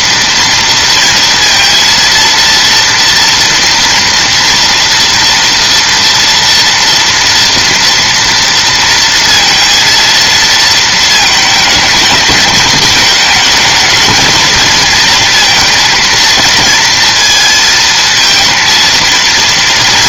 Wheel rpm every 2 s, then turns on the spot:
230, 230, 230, 230, 230, 230, 210, 230, 230, 230.
none